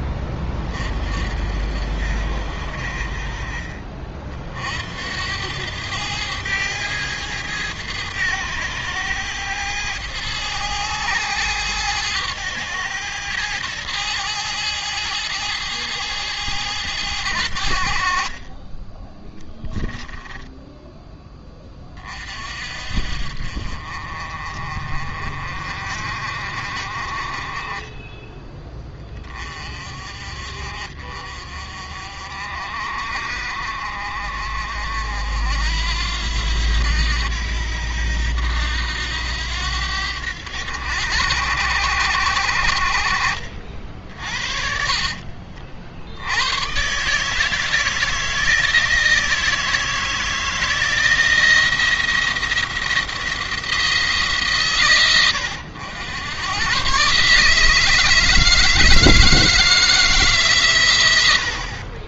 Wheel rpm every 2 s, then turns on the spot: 40, 50, 70, 110, 100, 110, 110, 110, 110, 30, 10, 50, 40, 40, 20, 50, 50, 60, 80, 80, 90, 70, 50, 120, 160, 160, 170, 140, 110, 160, 130.
44-46